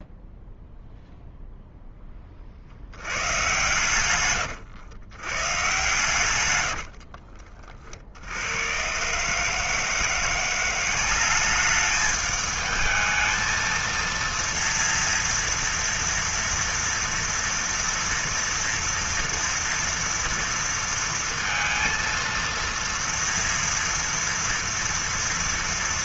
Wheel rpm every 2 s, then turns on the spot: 0, 60, 110, 80, 100, 180, 220, 230, 230, 240, 230, 230, 230.
6-8